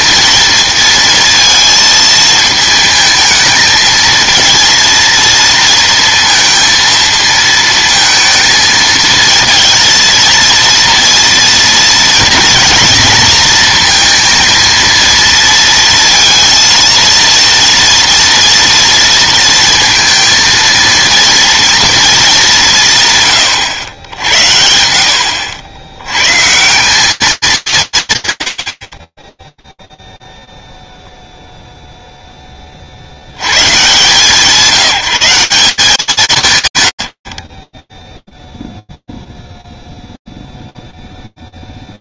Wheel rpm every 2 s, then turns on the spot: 230, 220, 230, 230, 220, 230, 230, 230, 230, 230, 230, 190, 80, 170, 90, 0, 20, 180, 130, 0, 0.
none